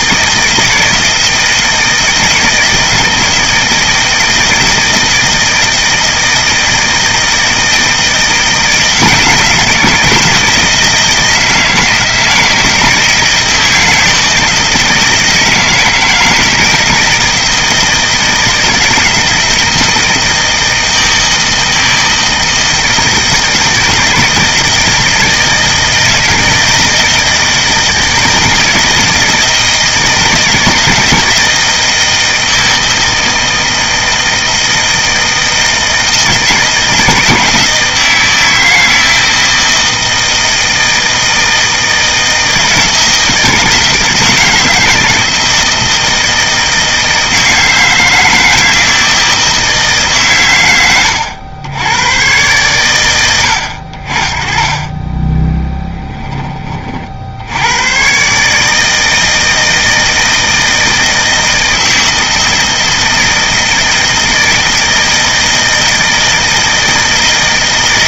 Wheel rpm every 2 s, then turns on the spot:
160, 160, 160, 160, 170, 160, 160, 160, 160, 160, 160, 160, 160, 160, 160, 160, 160, 160, 160, 160, 160, 160, 160, 160, 160, 100, 110, 20, 40, 160, 160, 160, 160, 160.
none